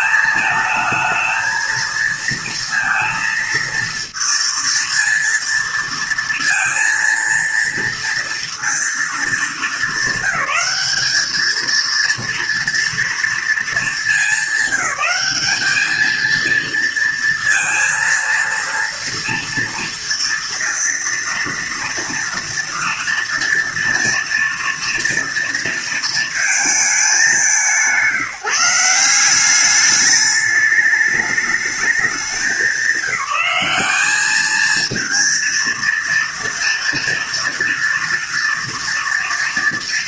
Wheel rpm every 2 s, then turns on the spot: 220, 230, 230, 230, 230, 200, 230, 200, 230, 230, 230, 230, 230, 210, 180, 210, 190, 220, 230, 230.
none